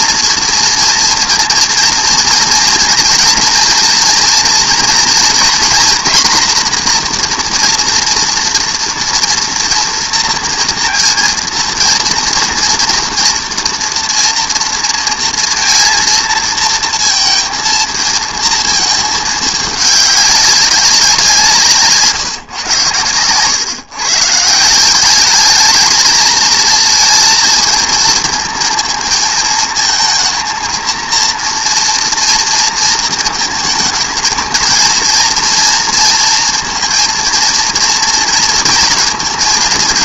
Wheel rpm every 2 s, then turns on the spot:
240, 230, 230, 240, 230, 230, 240, 230, 230, 220, 190, 120, 180, 220, 220, 230, 230, 230, 230, 230.
none